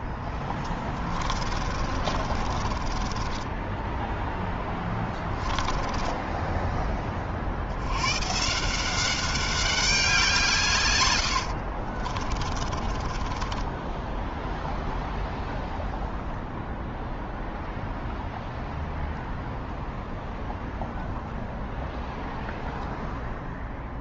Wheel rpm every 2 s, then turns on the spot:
30, 20, 20, 50, 200, 80, 20, 0, 0, 0, 0, 0.
0-6 10-14